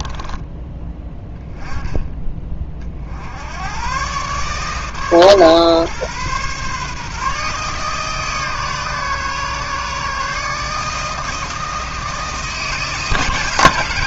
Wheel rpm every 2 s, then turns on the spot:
10, 30, 140, 140, 150, 150, 160.
none